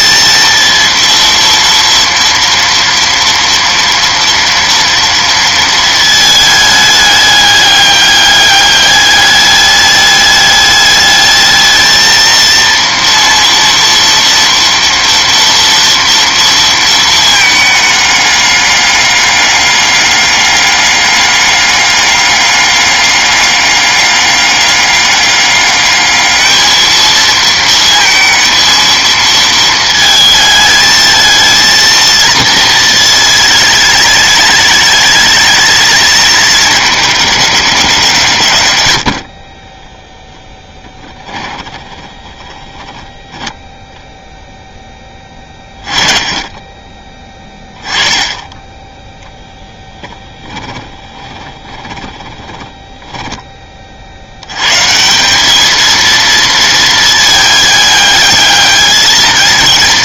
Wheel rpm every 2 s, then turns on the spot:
230, 230, 230, 210, 200, 210, 230, 230, 230, 200, 200, 200, 200, 220, 220, 220, 230, 230, 220, 120, 10, 20, 10, 20, 10, 10, 10, 110, 220, 210.
40-44 50-54